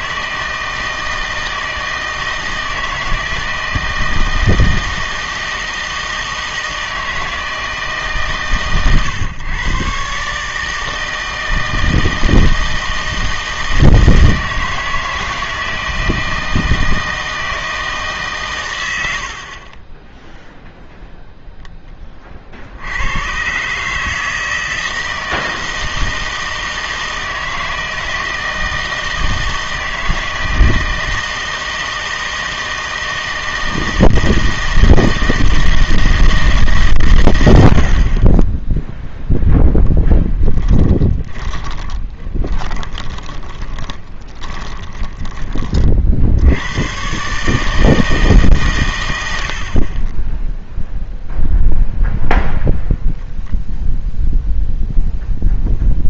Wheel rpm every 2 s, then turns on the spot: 160, 160, 160, 160, 120, 150, 160, 160, 160, 110, 0, 60, 160, 160, 160, 160, 160, 160, 140, 10, 20, 20, 20, 100, 130, 0, 0, 0.
40-46